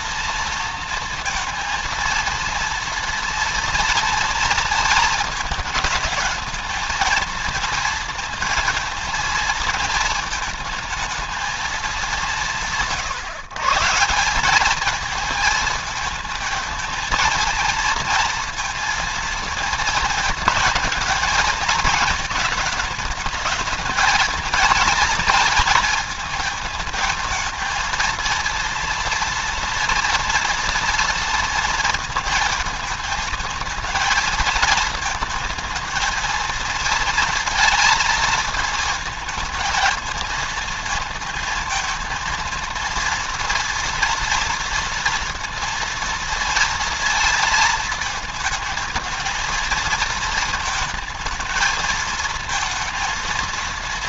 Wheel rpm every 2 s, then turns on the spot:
230, 230, 230, 220, 230, 220, 180, 210, 220, 230, 220, 220, 220, 220, 230, 240, 220, 230, 230, 220, 230, 230, 230, 230, 220, 230, 220.
none